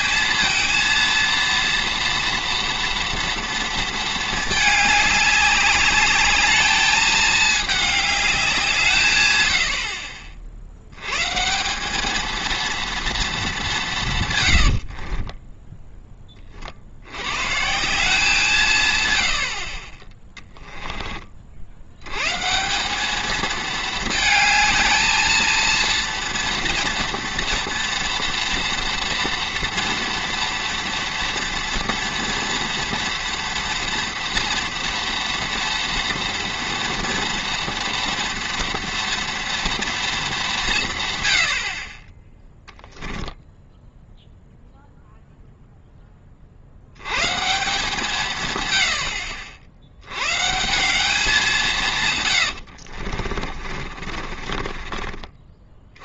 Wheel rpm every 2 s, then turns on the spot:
230, 230, 210, 210, 170, 70, 230, 80, 60, 140, 10, 190, 220, 230, 230, 230, 230, 230, 230, 230, 160, 0, 0, 70, 100, 180, 70, 30.
14-16 20-22 52-56